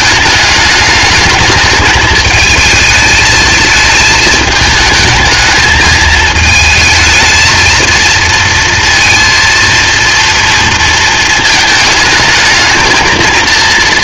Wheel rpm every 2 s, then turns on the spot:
220, 220, 220, 220, 230, 230, 220.
none